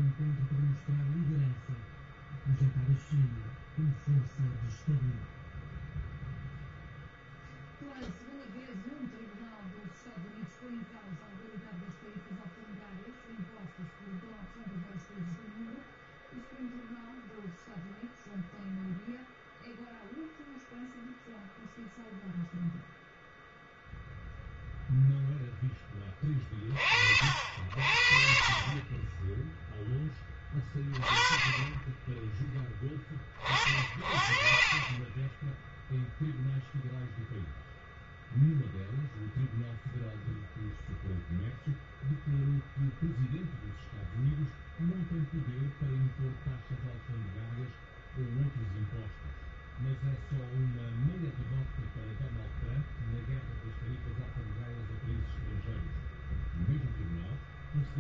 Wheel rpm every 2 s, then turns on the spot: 0, 0, 0, 0, 0, 0, 0, 0, 0, 0, 0, 0, 0, 30, 30, 20, 10, 40, 0, 0, 0, 0, 0, 0, 0, 0, 0, 0, 0.
none